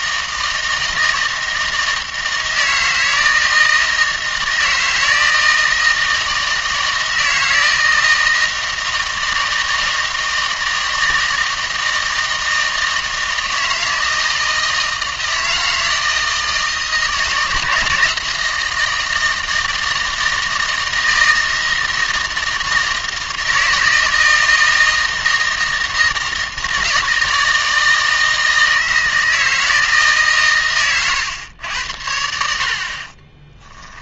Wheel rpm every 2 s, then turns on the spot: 160, 160, 160, 160, 160, 160, 160, 160, 160, 160, 160, 160, 160, 160, 160, 130, 80.
none